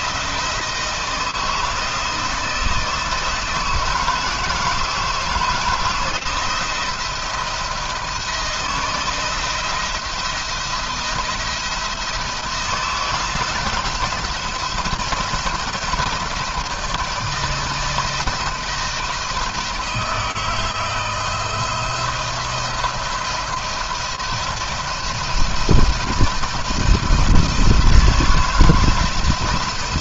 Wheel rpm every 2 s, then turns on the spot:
160, 160, 160, 170, 160, 170, 170, 170, 160, 170, 160, 170, 170, 170, 160.
none